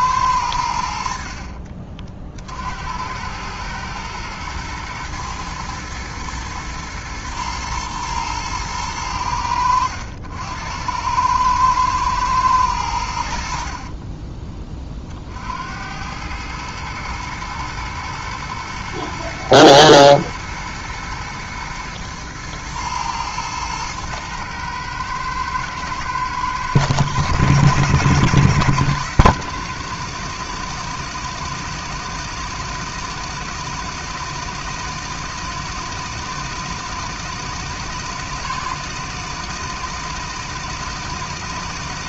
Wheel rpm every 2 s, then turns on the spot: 60, 90, 120, 120, 90, 100, 80, 60, 110, 110, 110, 110, 110, 100, 110, 120, 120, 120, 120, 120, 120.
0-2